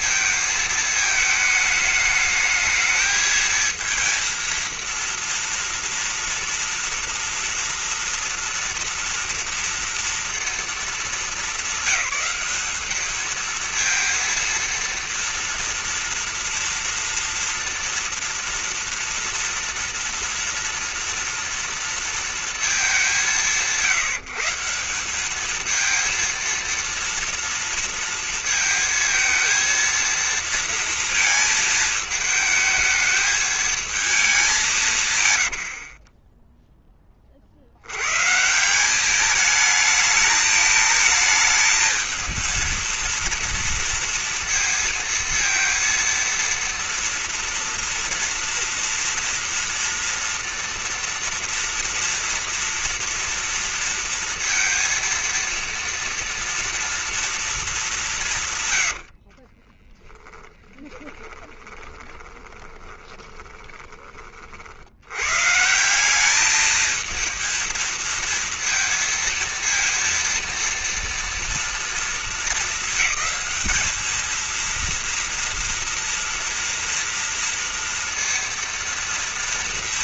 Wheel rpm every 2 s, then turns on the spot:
220, 220, 230, 230, 230, 230, 200, 230, 230, 230, 230, 220, 170, 230, 230, 230, 220, 200, 20, 150, 220, 230, 230, 230, 230, 230, 230, 230, 230, 140, 10, 20, 50, 210, 230, 230, 220, 220, 230, 230.
36-38 60-64